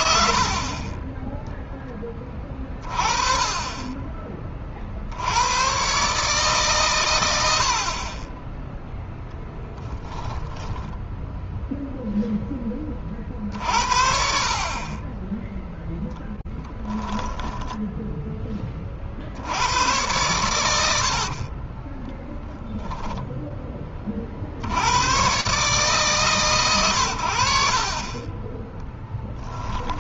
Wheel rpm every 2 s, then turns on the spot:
30, 30, 50, 130, 10, 10, 20, 30, 20, 30, 100, 10, 90, 120, 20.
10-12 16-18 20-24 28-30